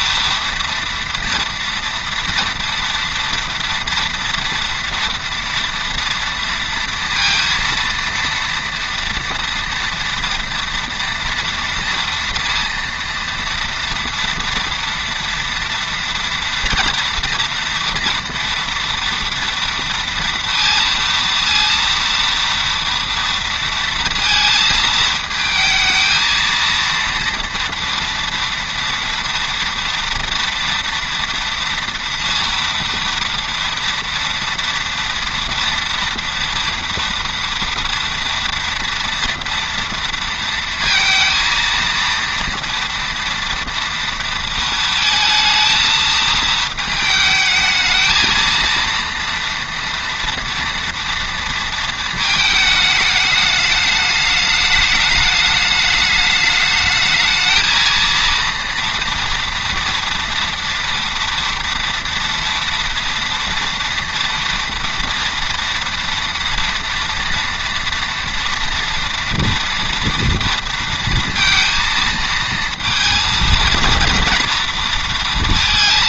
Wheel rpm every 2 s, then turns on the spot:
230, 230, 230, 230, 230, 230, 230, 230, 230, 240, 230, 230, 220, 230, 230, 230, 230, 230, 230, 240, 230, 230, 230, 220, 230, 230, 220, 210, 210, 230, 230, 240, 230, 230, 230, 230, 230, 230.
none